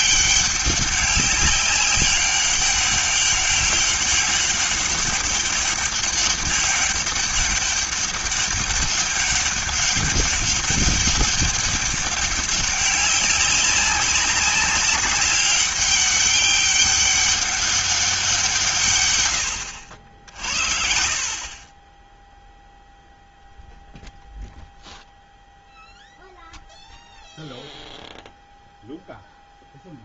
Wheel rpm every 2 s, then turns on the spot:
190, 200, 200, 200, 200, 200, 200, 190, 200, 160, 50, 0, 0, 0, 0.
none